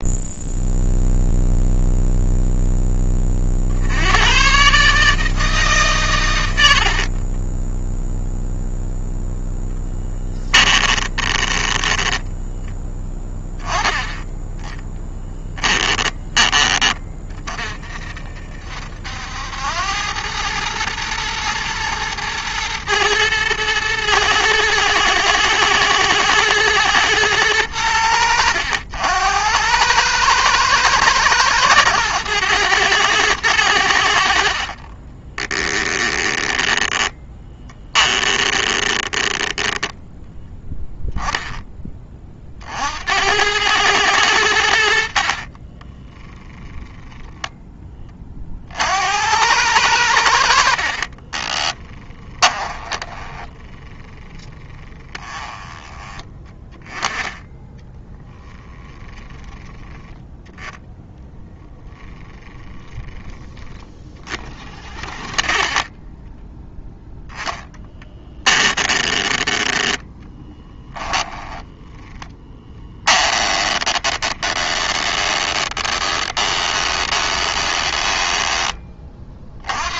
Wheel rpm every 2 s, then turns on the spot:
0, 10, 140, 60, 0, 20, 10, 10, 20, 70, 110, 110, 110, 120, 80, 110, 110, 30, 10, 20, 10, 70, 70, 10, 70, 50, 10, 20, 10, 10, 0, 10, 30, 10, 20, 20, 10, 20, 20, 20.
6-8 10-12 34-40 50-58 70-78